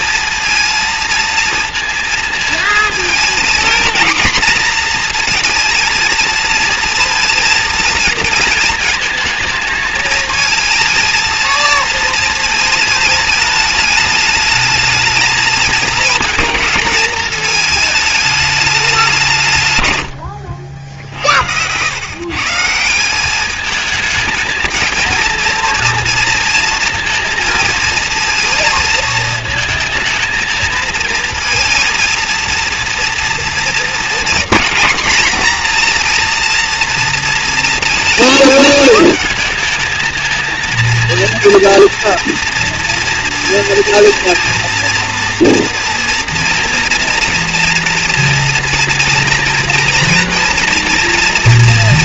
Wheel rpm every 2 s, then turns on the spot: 230, 220, 230, 230, 230, 220, 220, 220, 220, 210, 70, 150, 220, 230, 230, 220, 230, 240, 230, 220, 220, 230, 230, 230, 230, 230.
none